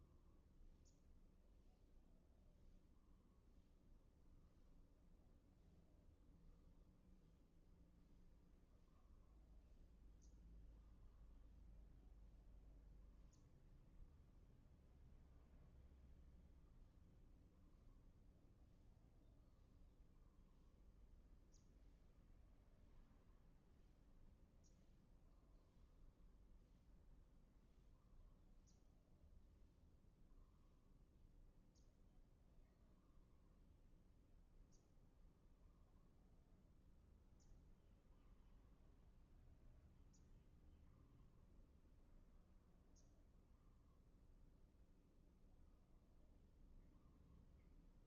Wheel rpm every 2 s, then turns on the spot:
0, 0, 0, 0, 0, 0, 0, 0, 0, 0, 0, 0, 0, 0, 0, 0, 0, 0, 0, 0, 0, 0, 0, 0.
none